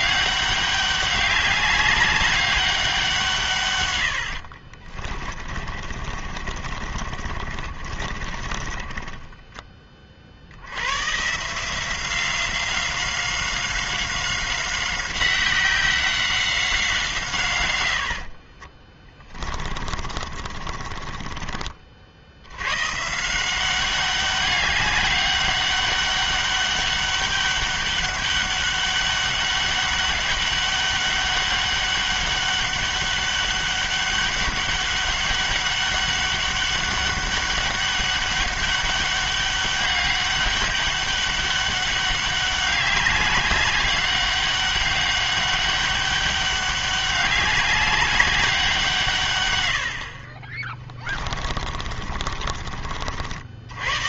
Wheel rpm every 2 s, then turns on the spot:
200, 200, 60, 40, 30, 80, 180, 190, 190, 30, 40, 100, 200, 200, 200, 200, 200, 200, 200, 200, 200, 200, 200, 200, 190, 30, 40.
4-10 18-22 52-54